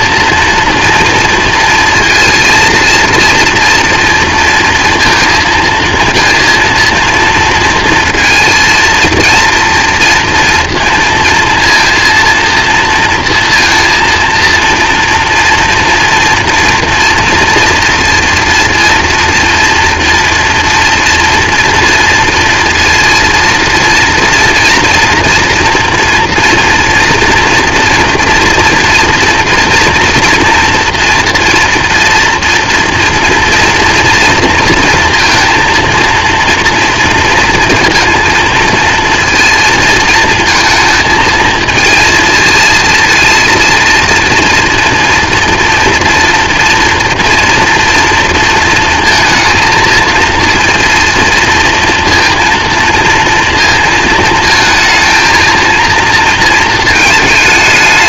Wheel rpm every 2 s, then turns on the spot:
230, 230, 230, 230, 230, 230, 230, 230, 240, 230, 230, 230, 230, 230, 240, 230, 230, 230, 230, 230, 220, 230, 230, 230, 230, 230, 230, 220, 220.
none